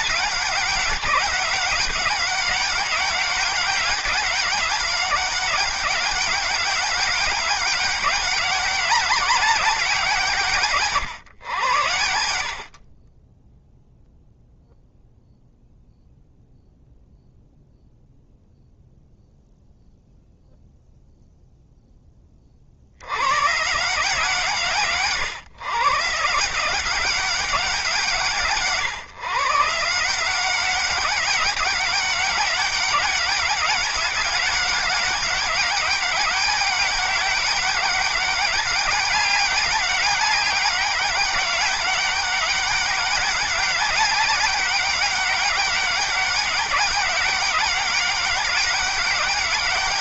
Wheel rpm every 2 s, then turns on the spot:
200, 200, 190, 200, 200, 130, 40, 0, 0, 0, 0, 70, 140, 180, 150, 190, 200, 200, 200, 200, 200, 200, 200, 190, 200.
none